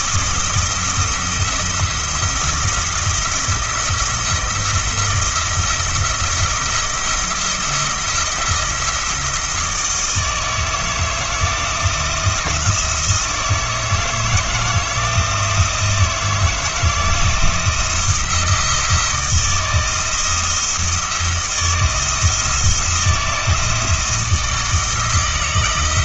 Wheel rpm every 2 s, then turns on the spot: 170, 170, 170, 170, 170, 160, 160, 160, 160, 170, 160, 170, 160.
none